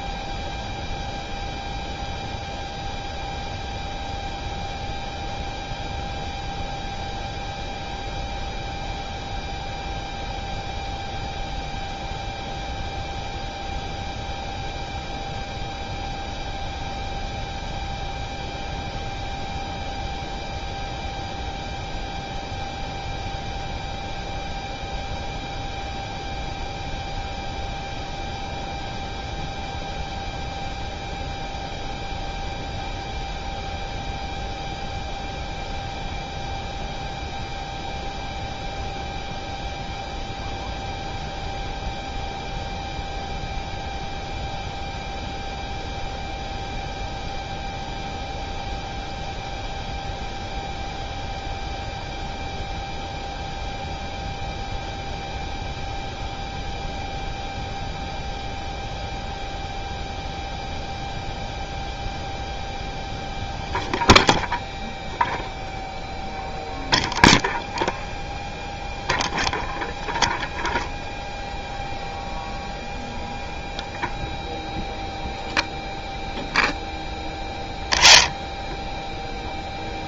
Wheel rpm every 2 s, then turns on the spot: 0, 0, 0, 0, 0, 0, 0, 0, 0, 0, 0, 0, 0, 0, 0, 0, 0, 0, 0, 0, 0, 0, 0, 0, 0, 0, 0, 0, 0, 0, 0, 0, 0, 0, 0, 0, 0, 0, 0, 0.
none